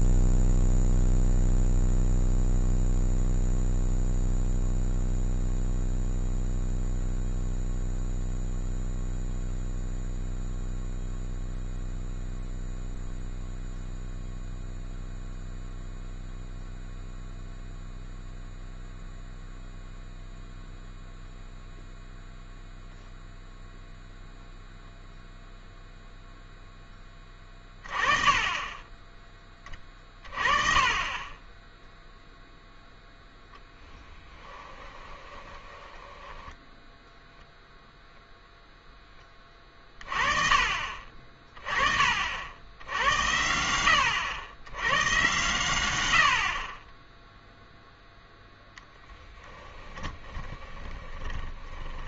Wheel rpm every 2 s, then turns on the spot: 0, 0, 0, 0, 0, 0, 0, 0, 0, 0, 0, 0, 0, 10, 20, 20, 0, 20, 10, 0, 40, 80, 100, 30, 10, 20.
34-36 48-52